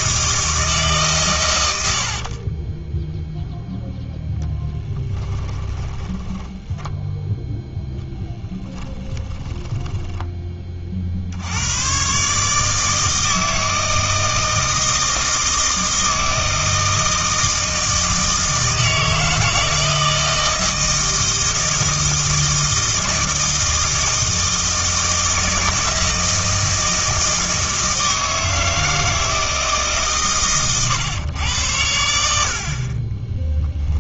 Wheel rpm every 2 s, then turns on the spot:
160, 20, 10, 10, 10, 30, 150, 160, 160, 160, 160, 160, 160, 160, 160, 120, 60.
2-10